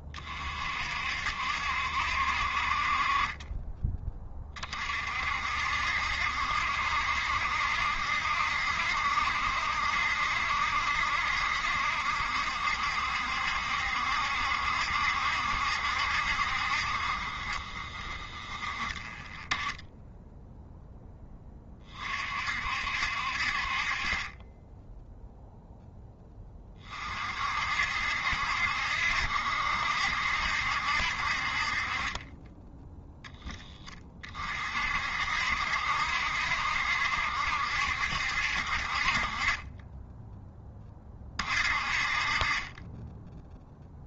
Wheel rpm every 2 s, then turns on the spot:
50, 40, 40, 70, 70, 70, 70, 70, 50, 20, 0, 60, 10, 30, 60, 70, 10, 50, 70, 60, 20, 20.
none